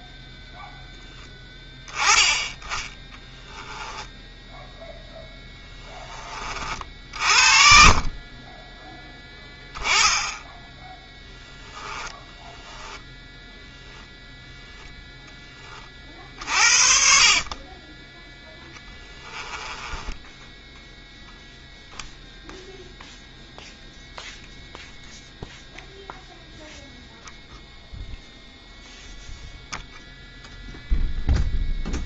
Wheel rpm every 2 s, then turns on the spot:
0, 10, 0, 40, 10, 10, 10, 10, 50, 10, 0, 0, 0, 0, 0, 0.
12-16 18-20